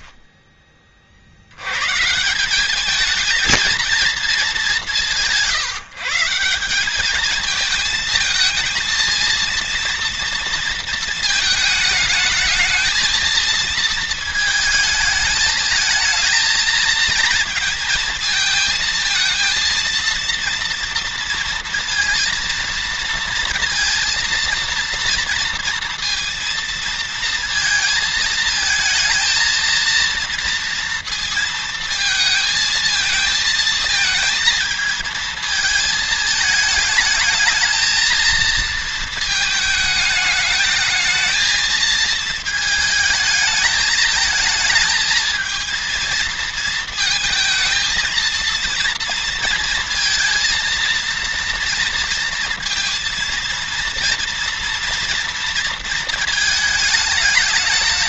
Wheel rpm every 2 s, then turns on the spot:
50, 210, 180, 200, 220, 230, 220, 220, 220, 220, 230, 230, 230, 230, 220, 230, 220, 220, 220, 230, 220, 220, 220, 220, 230, 230, 230, 230, 210.
none